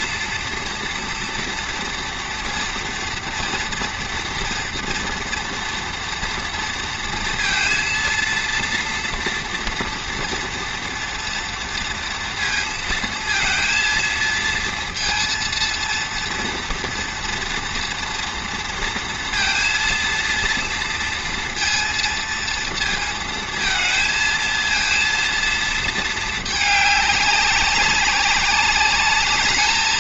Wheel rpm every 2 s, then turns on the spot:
230, 230, 230, 230, 230, 230, 230, 230, 230, 230, 230, 230, 230, 210, 200.
none